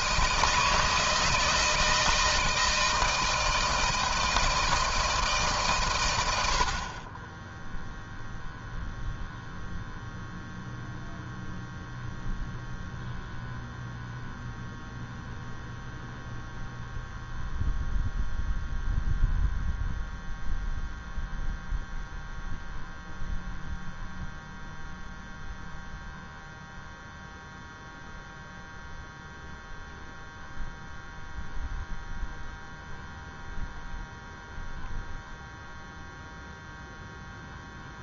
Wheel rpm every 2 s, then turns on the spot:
160, 160, 160, 40, 0, 0, 0, 0, 0, 0, 0, 0, 0, 0, 0, 0, 0, 0, 0.
none